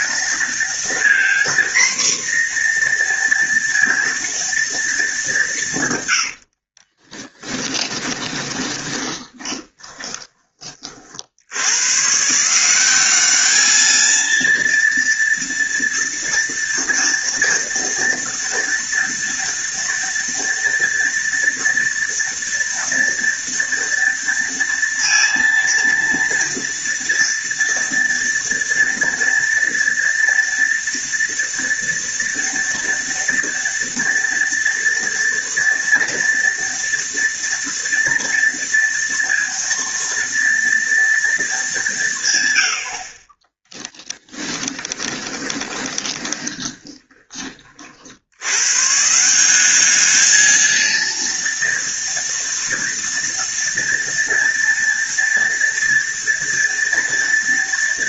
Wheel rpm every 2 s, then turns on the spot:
230, 240, 230, 50, 20, 30, 180, 230, 230, 230, 230, 230, 230, 230, 230, 230, 230, 230, 230, 230, 230, 80, 20, 20, 130, 230, 230, 230, 240.
6-10 44-48